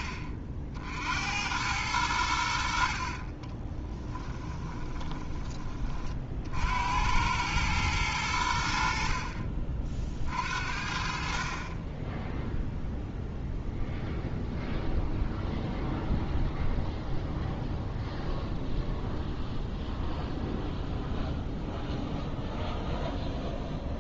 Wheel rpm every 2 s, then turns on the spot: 50, 60, 10, 80, 60, 50, 0, 0, 0, 0, 0, 0.
4-6